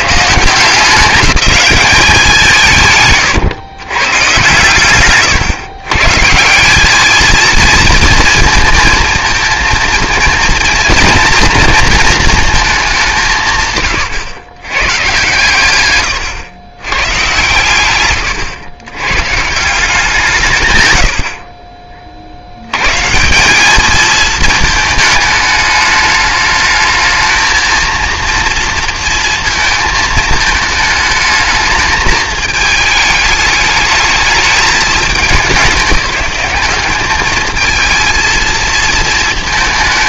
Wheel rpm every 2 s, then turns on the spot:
160, 160, 130, 170, 230, 230, 220, 110, 130, 110, 150, 90, 220, 210, 230, 220, 220, 210, 200, 220.
none